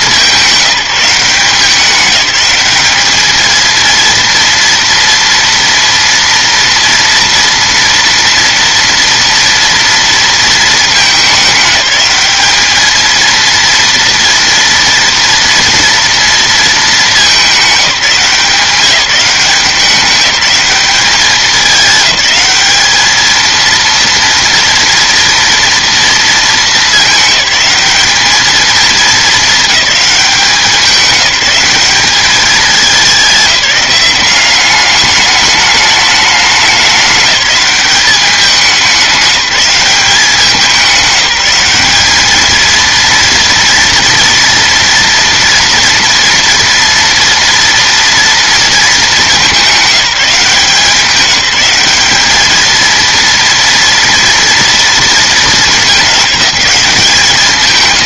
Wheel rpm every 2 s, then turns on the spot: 190, 200, 230, 230, 230, 220, 210, 230, 220, 180, 200, 210, 240, 210, 210, 190, 210, 200, 210, 200, 200, 220, 230, 230, 230, 180, 220, 230, 200.
none